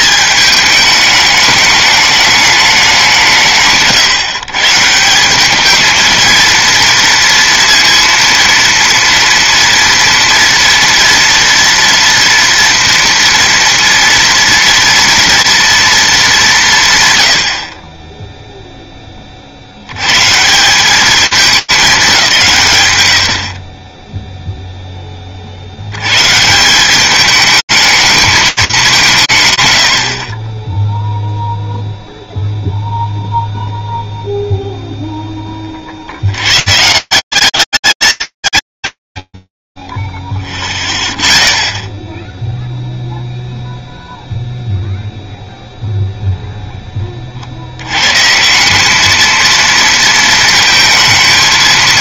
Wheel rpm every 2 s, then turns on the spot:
210, 200, 150, 230, 230, 230, 230, 230, 150, 10, 190, 120, 20, 190, 180, 0, 0, 0, 160, 150, 0, 0, 0, 30, 220, 220.
none